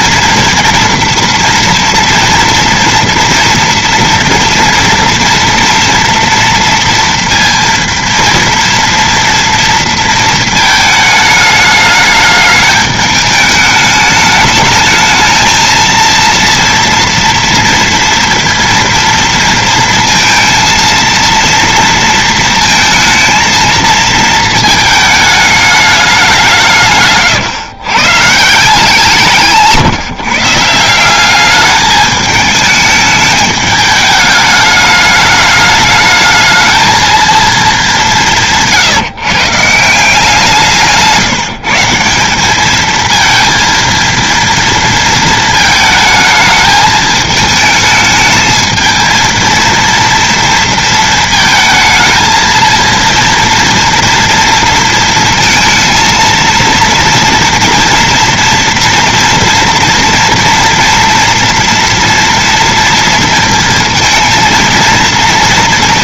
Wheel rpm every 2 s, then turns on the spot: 240, 230, 230, 230, 230, 220, 210, 210, 230, 230, 230, 230, 220, 190, 130, 150, 210, 210, 210, 190, 170, 180, 230, 220, 220, 230, 220, 240, 230, 240, 230, 230, 230.
none